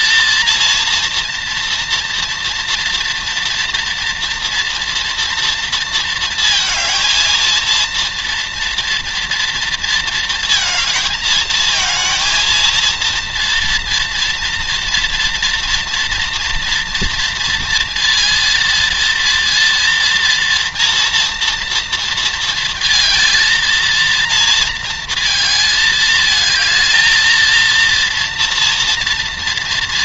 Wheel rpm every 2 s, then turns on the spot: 230, 230, 230, 230, 230, 230, 230, 230, 230, 230, 230, 230, 230, 210, 230.
none